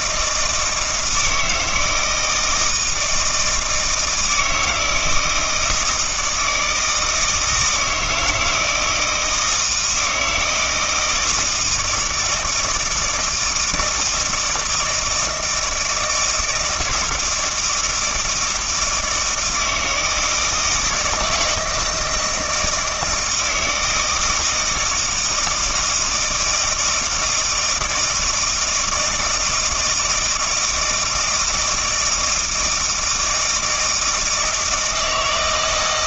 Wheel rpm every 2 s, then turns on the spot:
160, 160, 160, 160, 160, 170, 160, 160, 160, 160, 160, 160, 160, 160, 160, 160, 160, 160.
none